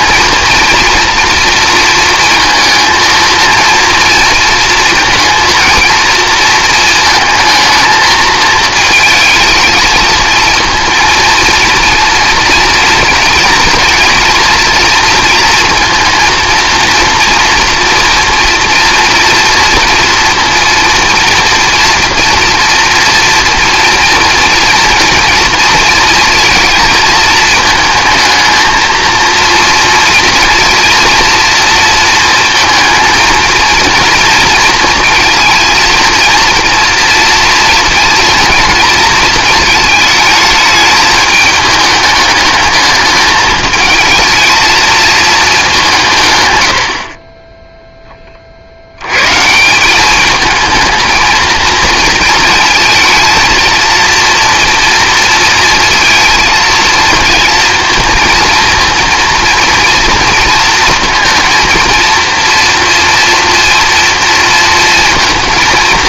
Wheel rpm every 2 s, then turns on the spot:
230, 230, 230, 230, 220, 230, 230, 230, 230, 230, 230, 240, 230, 230, 230, 230, 230, 230, 230, 220, 210, 210, 220, 110, 60, 220, 230, 230, 230, 230, 230, 240, 230.
none